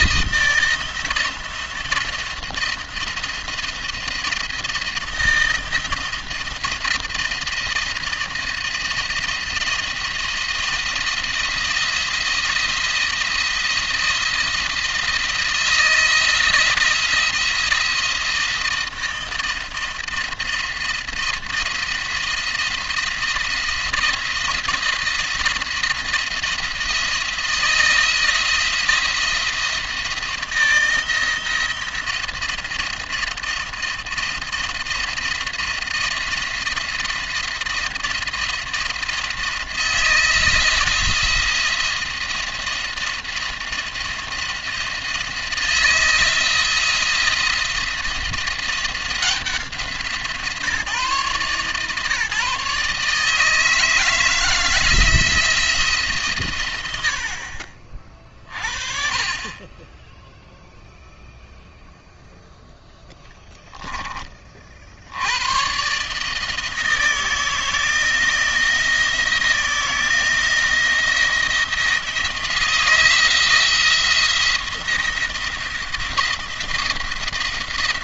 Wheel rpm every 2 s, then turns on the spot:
160, 170, 170, 170, 170, 170, 170, 170, 170, 170, 170, 170, 170, 170, 160, 170, 170, 170, 170, 170, 170, 170, 170, 170, 170, 150, 140, 160, 80, 40, 0, 0, 70, 160, 170, 170, 170, 170, 170.
none